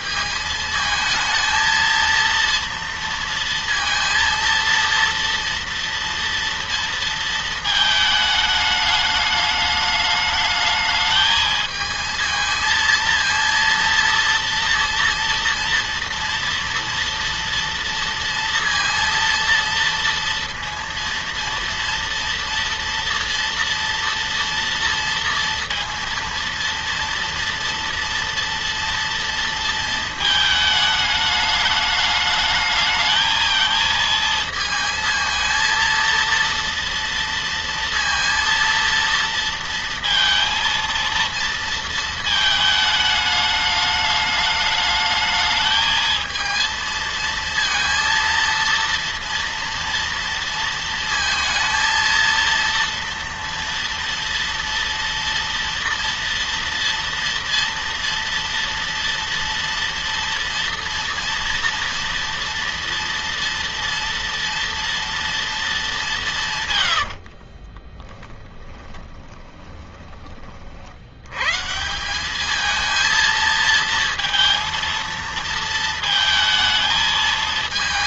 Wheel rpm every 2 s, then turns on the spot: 220, 230, 230, 230, 210, 220, 230, 230, 230, 230, 230, 230, 230, 230, 230, 220, 220, 230, 230, 230, 230, 220, 210, 220, 230, 230, 230, 230, 230, 240, 230, 230, 230, 100, 20, 60, 220, 230, 220.
66-70